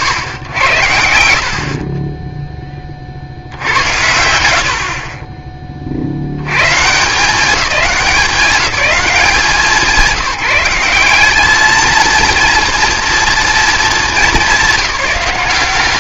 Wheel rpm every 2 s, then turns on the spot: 90, 20, 60, 110, 200, 210, 240, 190.
none